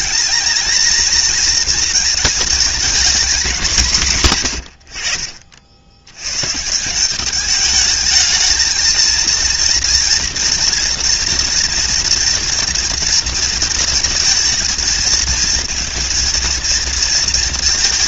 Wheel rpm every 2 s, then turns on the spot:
230, 230, 70, 180, 220, 230, 230, 220, 230.
none